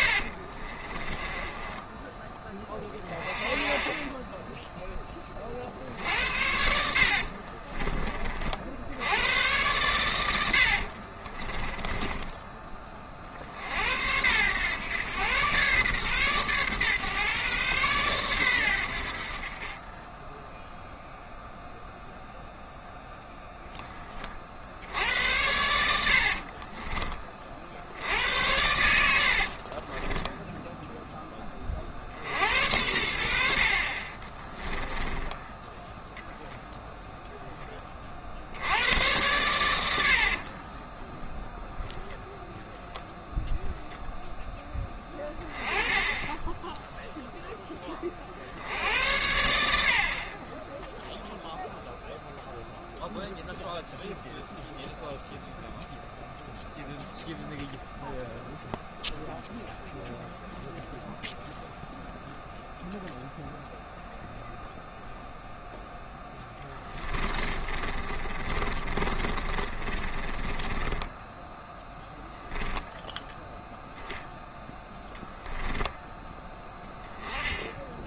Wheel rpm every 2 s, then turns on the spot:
30, 30, 10, 60, 60, 60, 20, 110, 130, 100, 0, 0, 70, 30, 90, 10, 70, 10, 0, 80, 20, 0, 10, 0, 90, 20, 0, 0, 0, 0, 0, 0, 0, 20, 30, 20, 10, 10, 10.
0-2 6-8 10-12 26-28 34-36 40-42 66-72